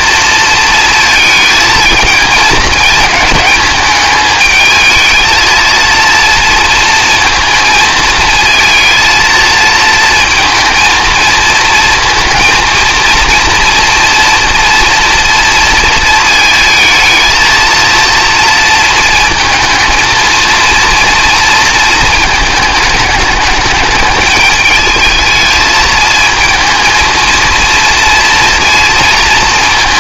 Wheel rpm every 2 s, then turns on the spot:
230, 220, 220, 230, 220, 230, 230, 230, 220, 230, 230, 220, 220, 220, 230.
none